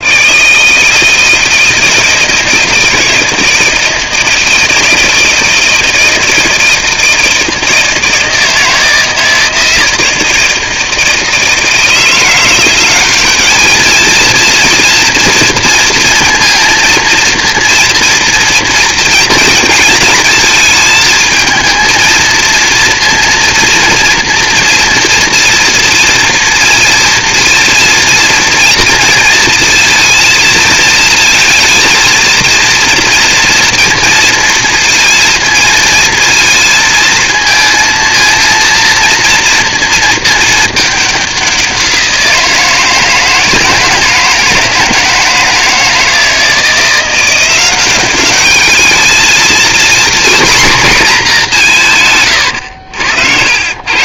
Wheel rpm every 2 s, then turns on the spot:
150, 160, 160, 170, 160, 160, 180, 230, 230, 230, 220, 230, 230, 230, 230, 230, 230, 230, 220, 230, 220, 170, 160, 170, 200, 240, 80.
52-54